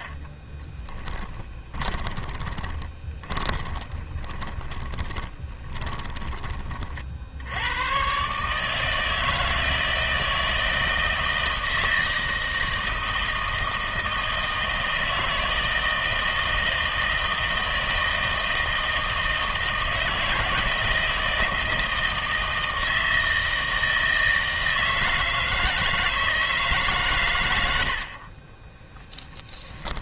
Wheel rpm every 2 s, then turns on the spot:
20, 20, 20, 40, 160, 160, 160, 160, 160, 160, 160, 160, 160, 150, 10.
0-6 28-30